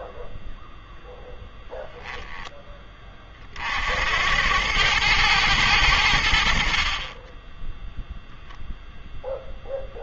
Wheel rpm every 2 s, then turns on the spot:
0, 10, 100, 50, 0.
none